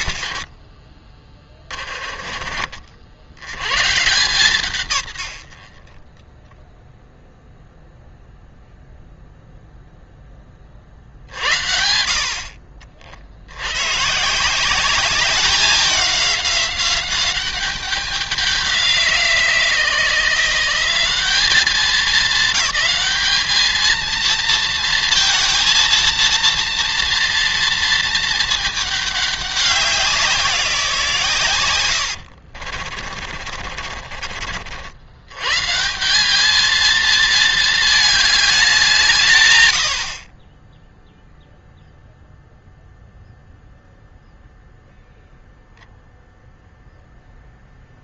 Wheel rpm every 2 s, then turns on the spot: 60, 40, 140, 0, 0, 30, 50, 180, 190, 180, 170, 200, 230, 230, 220, 170, 50, 70, 210, 190, 30, 0, 0, 0.
0-2 32-34